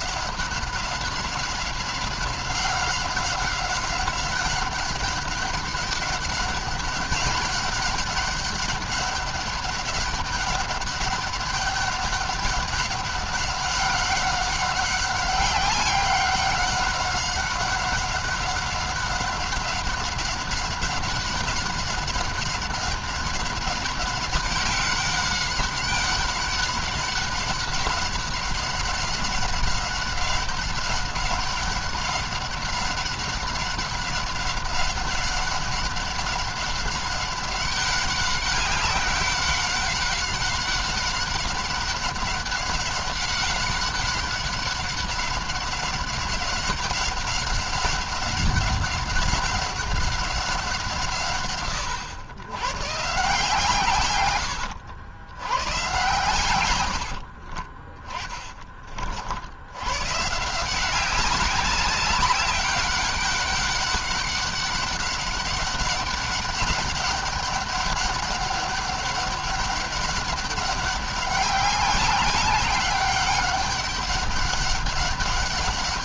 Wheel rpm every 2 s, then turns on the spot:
190, 190, 190, 200, 200, 200, 200, 190, 190, 190, 190, 190, 190, 190, 190, 190, 190, 200, 190, 190, 190, 190, 190, 190, 190, 170, 130, 110, 100, 30, 160, 190, 200, 200, 200, 200, 190, 200.
none